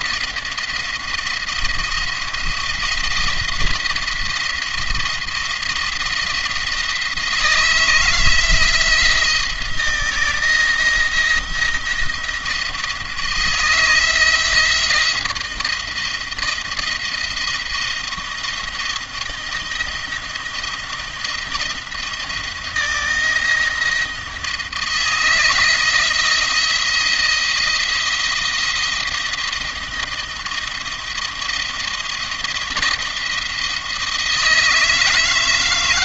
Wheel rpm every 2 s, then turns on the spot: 170, 170, 170, 160, 170, 170, 160, 160, 170, 170, 170, 170, 160, 170, 170, 170, 170, 160.
none